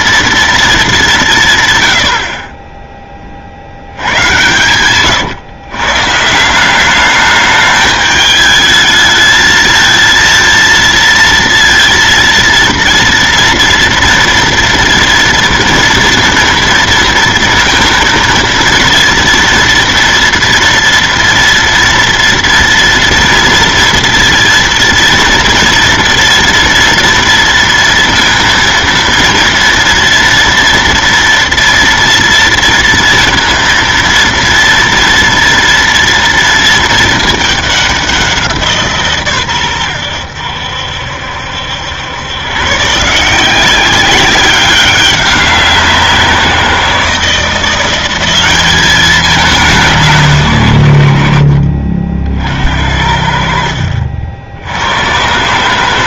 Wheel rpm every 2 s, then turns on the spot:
220, 20, 110, 180, 210, 230, 230, 230, 230, 230, 230, 230, 230, 230, 230, 230, 230, 230, 230, 170, 80, 130, 200, 170, 190, 110, 70, 70.
4-6